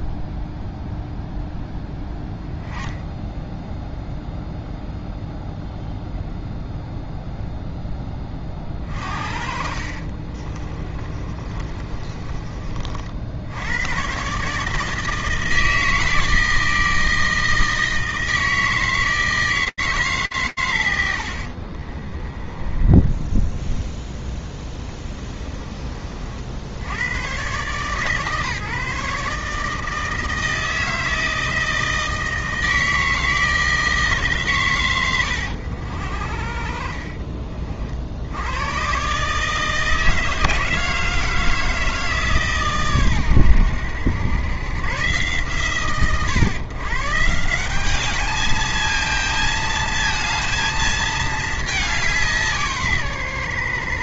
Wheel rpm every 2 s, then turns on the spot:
0, 10, 0, 0, 40, 30, 40, 150, 160, 160, 110, 10, 10, 70, 150, 160, 160, 120, 50, 110, 160, 130, 100, 120, 220, 220, 140.
10-12 22-26